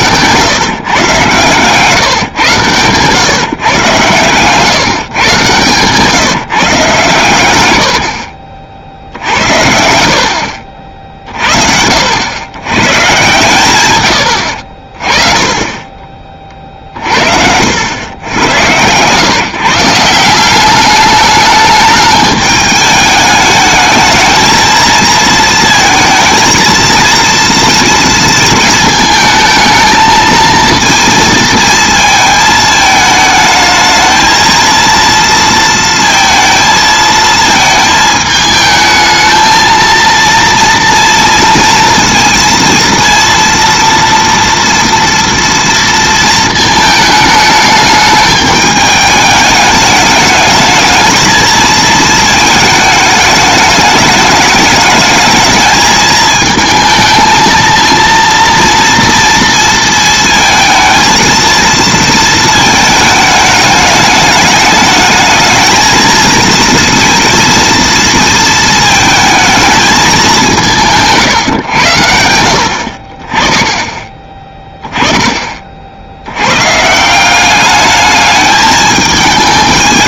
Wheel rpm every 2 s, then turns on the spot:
130, 130, 150, 140, 60, 60, 130, 50, 50, 110, 200, 210, 220, 230, 220, 230, 220, 230, 220, 220, 230, 230, 230, 220, 210, 220, 220, 210, 220, 230, 220, 220, 210, 230, 220, 180, 60, 10, 140, 210.
16-18